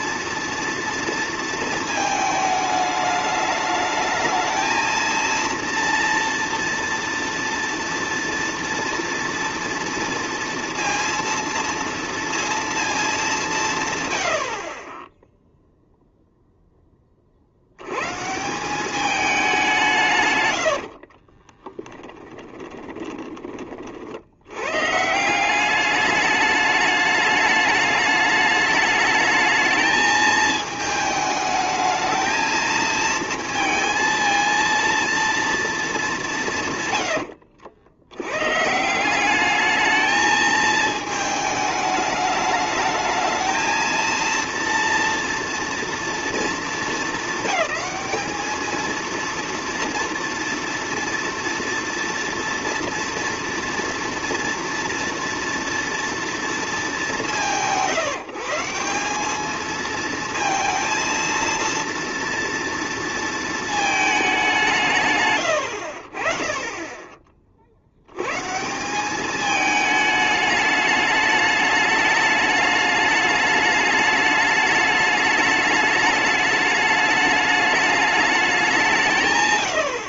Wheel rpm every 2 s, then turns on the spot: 230, 210, 220, 230, 230, 230, 230, 30, 10, 180, 90, 20, 120, 210, 210, 220, 220, 230, 150, 140, 220, 210, 230, 230, 220, 230, 230, 230, 210, 170, 230, 230, 190, 20, 150, 210, 210, 210, 210, 200.
20-24